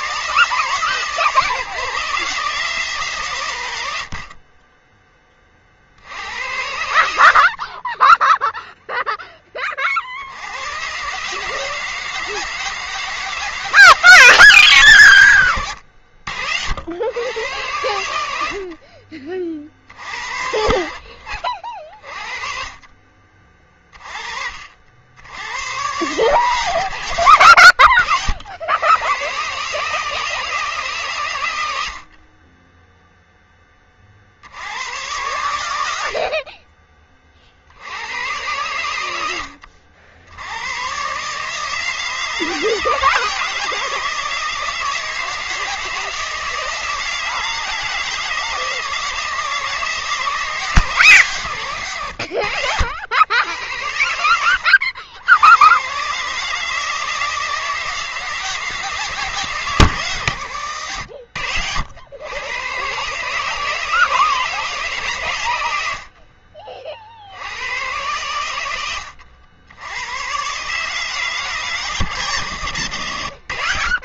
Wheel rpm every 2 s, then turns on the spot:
150, 160, 10, 80, 0, 110, 160, 140, 80, 60, 60, 30, 50, 130, 100, 150, 10, 90, 30, 100, 110, 160, 160, 160, 160, 160, 80, 90, 150, 160, 90, 120, 150, 40, 100, 140, 120.
none